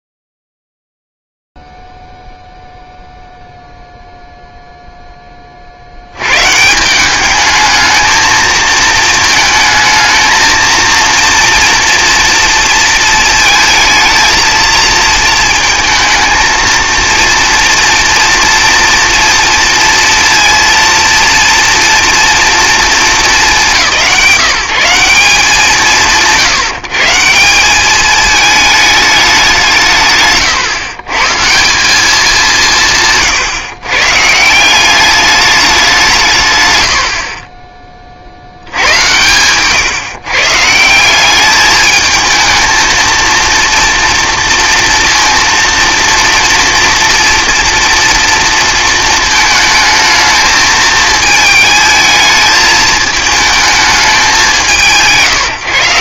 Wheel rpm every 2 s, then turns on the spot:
0, 0, 0, 110, 220, 220, 230, 220, 220, 230, 230, 230, 170, 140, 210, 140, 190, 150, 160, 70, 140, 220, 240, 230, 230, 220, 220, 190.
30-32